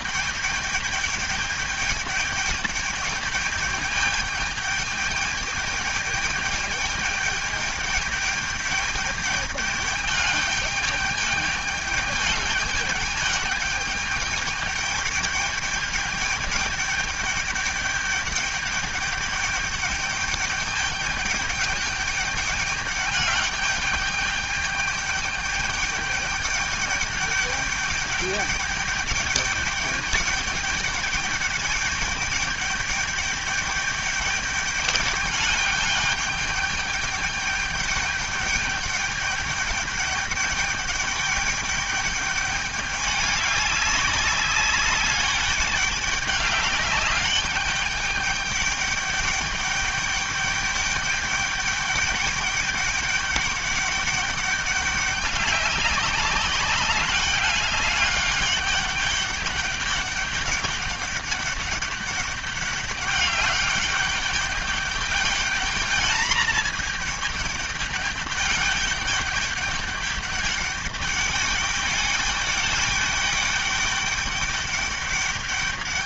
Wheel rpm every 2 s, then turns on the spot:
210, 210, 210, 210, 210, 210, 210, 210, 210, 210, 200, 210, 210, 210, 210, 210, 210, 210, 210, 210, 210, 200, 200, 200, 210, 210, 210, 200, 200, 200, 200, 200, 200, 220, 210, 200, 210, 200.
none